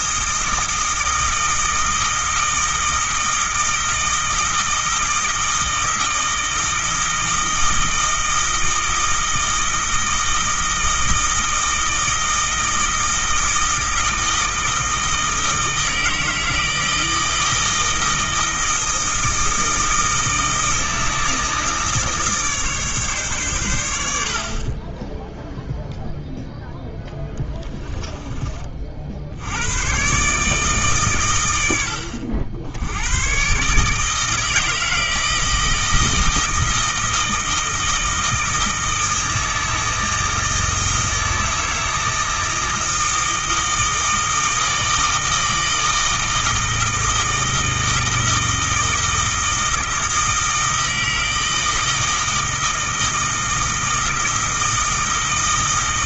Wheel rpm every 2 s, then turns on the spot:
160, 160, 160, 160, 160, 160, 160, 160, 160, 160, 160, 150, 30, 0, 40, 140, 80, 160, 160, 160, 160, 160, 160, 160, 160, 160, 160, 160.
none